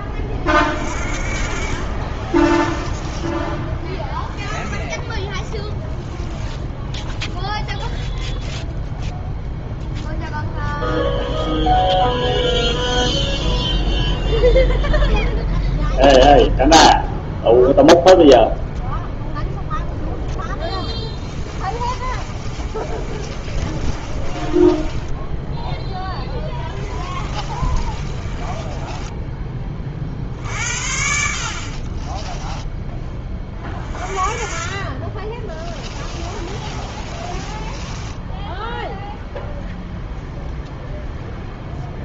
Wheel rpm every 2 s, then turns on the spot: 40, 10, 10, 0, 0, 0, 0, 0, 0, 0, 10, 30, 10, 20, 20, 70, 10, 30, 30, 0, 0.
2-4 20-30 36-38